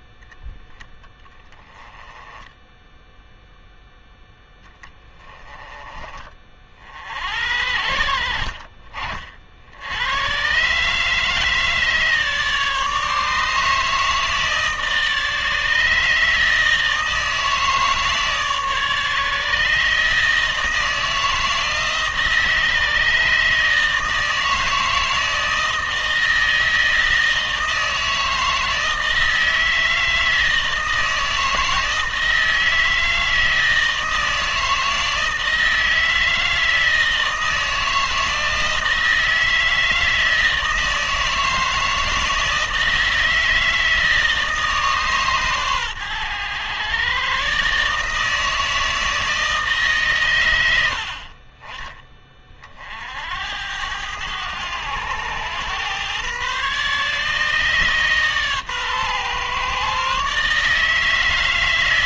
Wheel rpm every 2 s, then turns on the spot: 10, 10, 10, 50, 40, 140, 150, 150, 160, 150, 160, 160, 160, 160, 160, 160, 160, 160, 160, 160, 160, 160, 150, 120, 160, 80, 50, 100, 140, 130, 150.
none